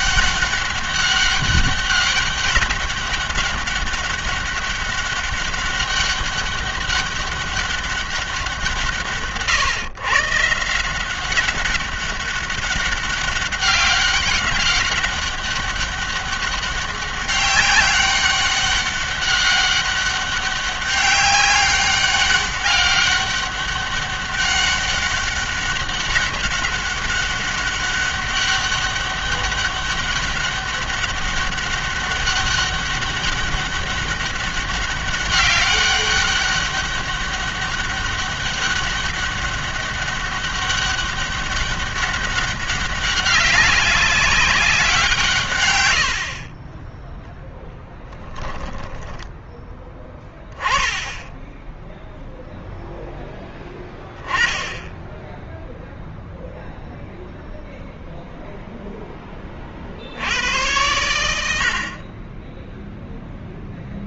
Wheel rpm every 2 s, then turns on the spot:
200, 200, 200, 200, 170, 170, 200, 200, 200, 200, 200, 200, 200, 200, 200, 200, 200, 200, 200, 200, 200, 200, 190, 30, 10, 10, 0, 10, 0, 0, 90, 10.
46-50